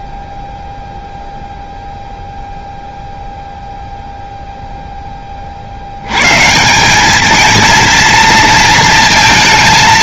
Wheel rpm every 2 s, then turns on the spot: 0, 0, 0, 160, 230.
none